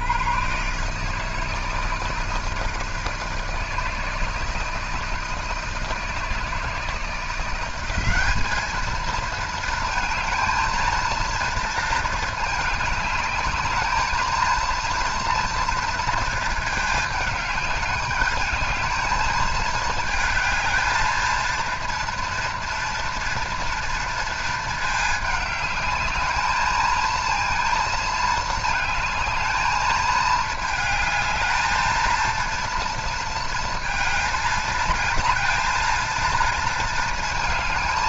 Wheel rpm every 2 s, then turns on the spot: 90, 160, 160, 160, 200, 220, 220, 230, 220, 210, 220, 230, 220, 220, 230, 220, 230, 220, 230.
none